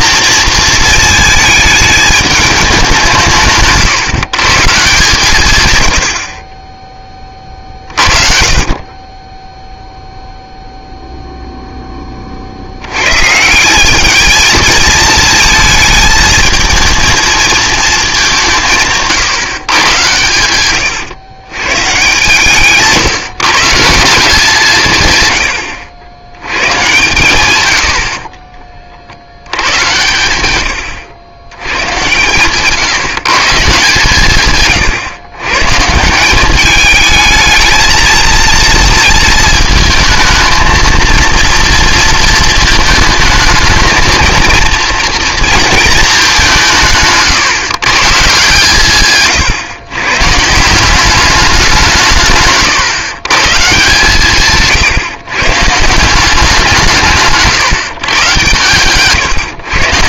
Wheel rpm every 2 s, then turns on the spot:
230, 200, 150, 20, 30, 0, 70, 220, 230, 160, 110, 150, 160, 110, 30, 90, 130, 130, 210, 230, 230, 220, 230, 170, 140, 170, 140, 140, 180, 130.
20-22